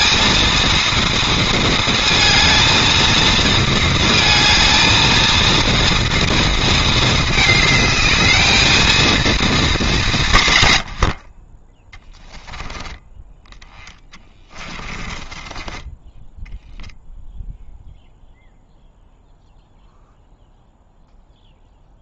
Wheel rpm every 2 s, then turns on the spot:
230, 230, 230, 220, 220, 90, 20, 30, 0, 0, 0.
14-16